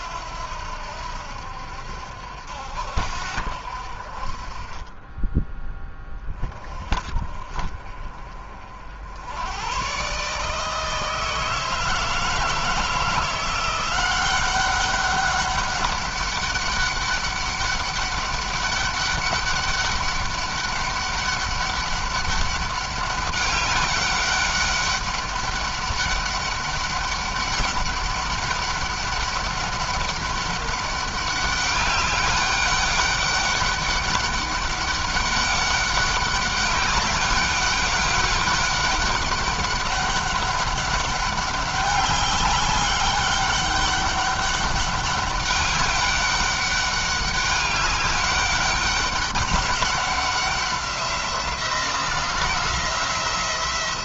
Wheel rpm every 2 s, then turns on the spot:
70, 70, 30, 30, 60, 150, 160, 190, 200, 200, 200, 200, 200, 200, 200, 200, 200, 200, 200, 200, 200, 200, 200, 200, 200, 190, 180.
none